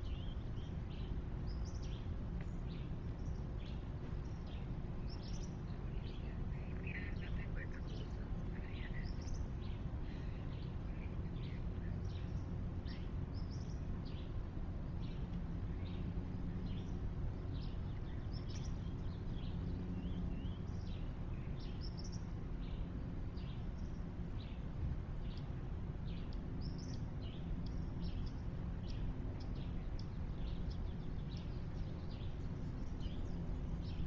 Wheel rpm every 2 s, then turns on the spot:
0, 0, 0, 0, 0, 0, 0, 0, 0, 0, 0, 0, 0, 0, 0, 0, 0.
none